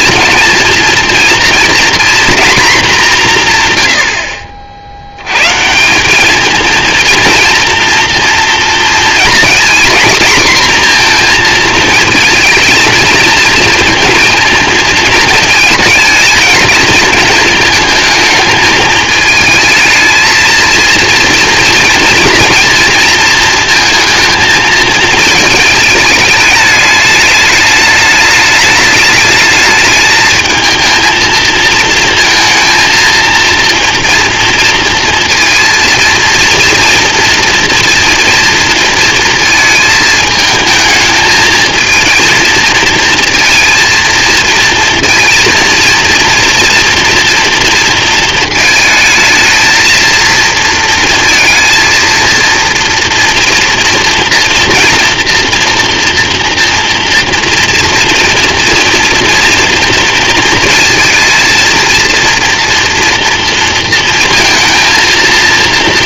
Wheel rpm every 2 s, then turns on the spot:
230, 230, 70, 220, 230, 240, 220, 220, 230, 220, 230, 230, 220, 220, 210, 220, 230, 230, 230, 230, 220, 230, 230, 230, 230, 230, 230, 240, 230, 230, 230, 230, 230.
none